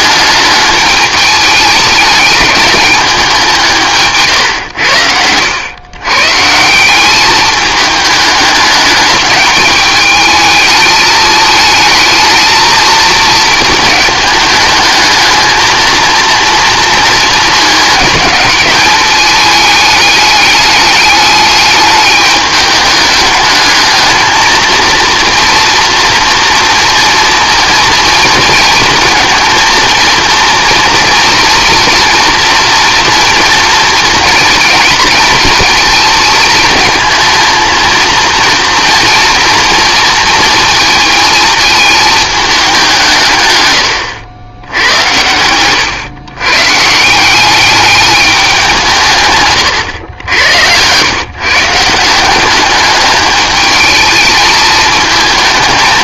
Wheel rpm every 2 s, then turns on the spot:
210, 200, 100, 170, 210, 220, 220, 210, 230, 210, 210, 210, 230, 230, 230, 230, 230, 230, 230, 230, 230, 190, 90, 140, 200, 110, 200, 220.
none